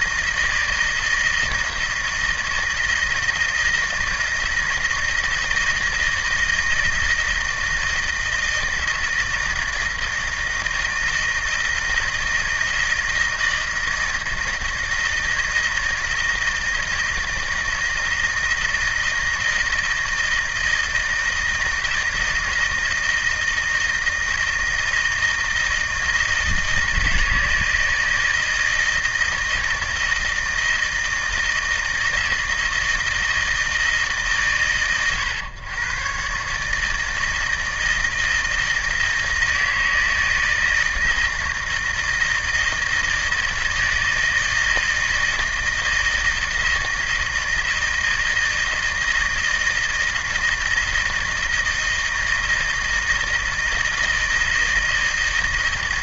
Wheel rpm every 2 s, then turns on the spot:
160, 160, 160, 160, 160, 160, 160, 160, 160, 160, 160, 160, 160, 160, 160, 160, 160, 120, 150, 160, 160, 160, 160, 160, 160, 160, 160, 160.
none